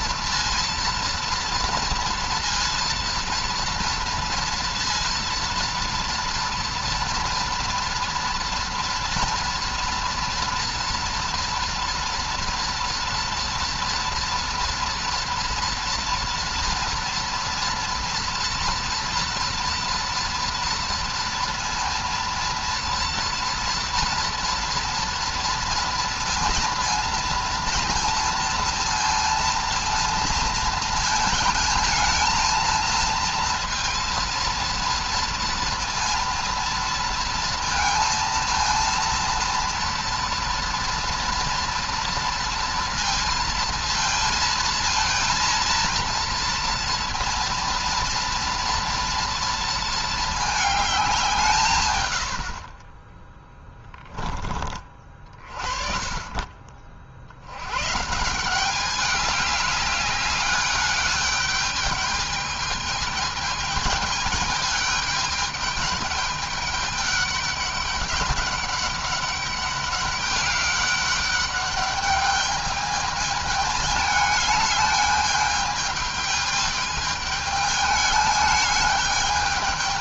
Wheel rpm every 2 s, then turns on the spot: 230, 230, 230, 230, 240, 230, 230, 230, 230, 230, 230, 230, 230, 230, 230, 230, 230, 230, 230, 230, 230, 230, 230, 230, 230, 210, 40, 30, 40, 180, 200, 220, 210, 210, 200, 200, 210, 210, 210, 210.
none